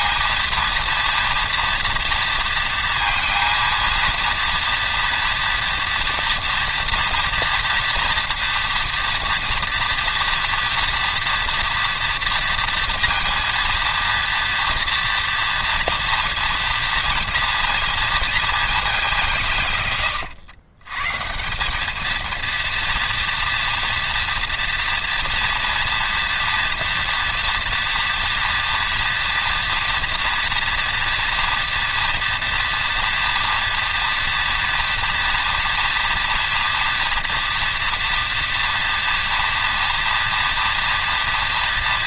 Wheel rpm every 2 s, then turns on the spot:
230, 230, 230, 240, 230, 230, 230, 230, 230, 220, 110, 230, 230, 240, 240, 240, 230, 240, 230, 230, 230.
none